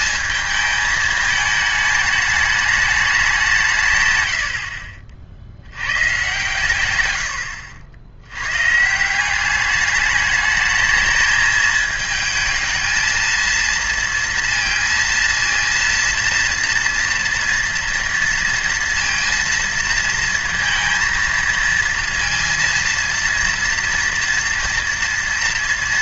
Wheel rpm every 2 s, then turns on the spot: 220, 210, 70, 120, 140, 210, 230, 230, 230, 230, 230, 230, 230.
none